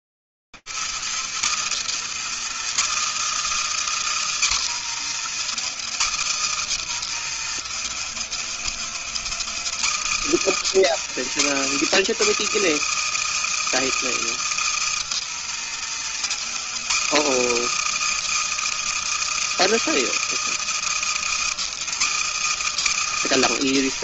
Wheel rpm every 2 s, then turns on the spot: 240, 270, 300, 270, 240, 290, 310, 310, 270, 330, 320, 310.
none